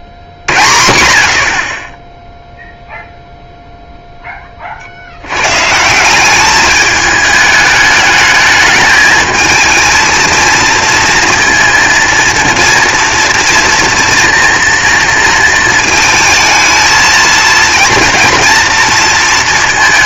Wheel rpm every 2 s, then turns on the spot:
30, 0, 30, 210, 210, 230, 240, 230, 220, 230.
none